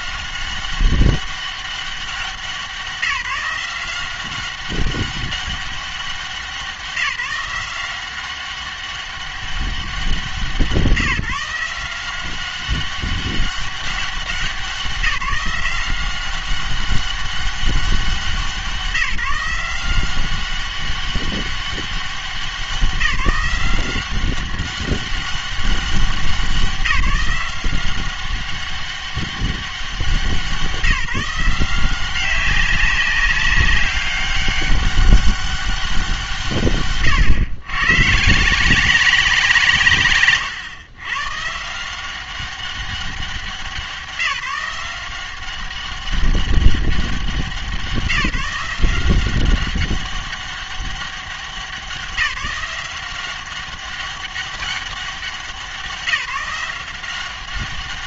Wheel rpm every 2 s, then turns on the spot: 190, 180, 190, 180, 190, 170, 190, 170, 190, 180, 190, 190, 190, 180, 200, 170, 190, 200, 140, 170, 120, 200, 170, 190, 170, 200, 180, 200, 170.
none